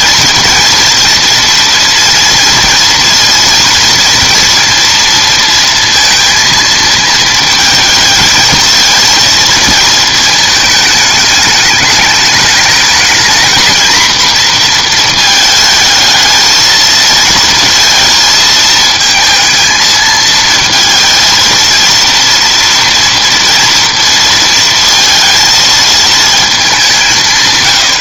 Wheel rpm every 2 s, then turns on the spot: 230, 230, 230, 230, 220, 220, 210, 240, 220, 220, 230, 230, 230, 220.
none